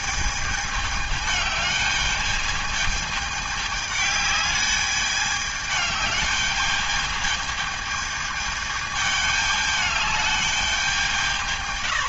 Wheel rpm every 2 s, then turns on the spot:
220, 210, 210, 210, 220, 210.
none